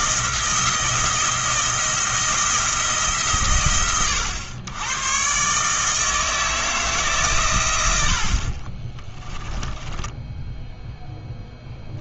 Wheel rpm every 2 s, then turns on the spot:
170, 170, 100, 160, 40, 10.
8-10